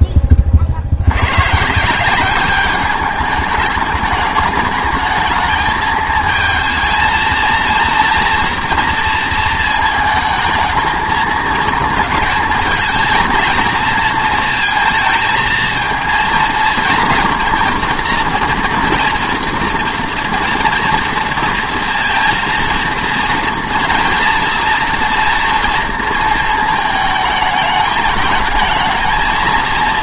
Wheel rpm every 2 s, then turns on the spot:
50, 200, 210, 220, 230, 220, 230, 230, 240, 240, 230, 230, 230, 220, 220.
none